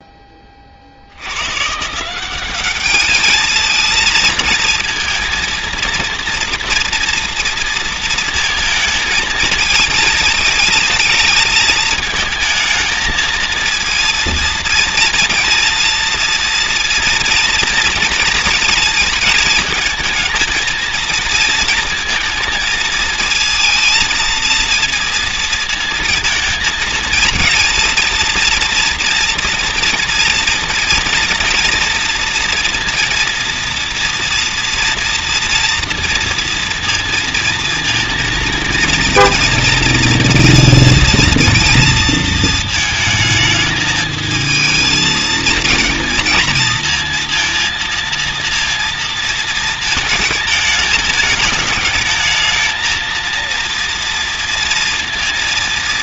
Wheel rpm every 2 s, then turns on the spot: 50, 210, 230, 230, 220, 220, 220, 230, 230, 230, 230, 230, 230, 230, 230, 240, 230, 230, 230, 230, 230, 220, 220, 230, 230, 220, 220, 230.
none